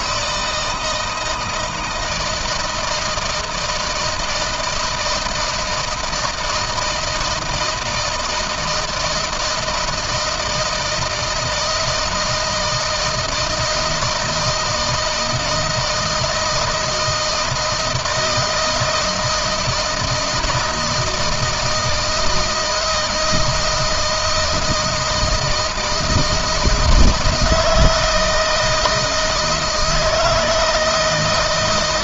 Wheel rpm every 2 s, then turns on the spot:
160, 160, 170, 160, 160, 160, 160, 160, 160, 160, 160, 160, 160, 160, 160, 160.
none